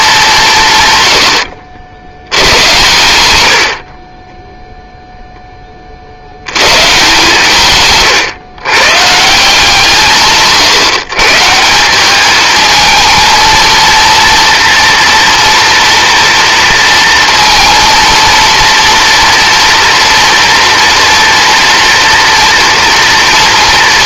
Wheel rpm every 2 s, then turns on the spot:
130, 110, 0, 130, 140, 140, 220, 230, 230, 230, 230, 230.
none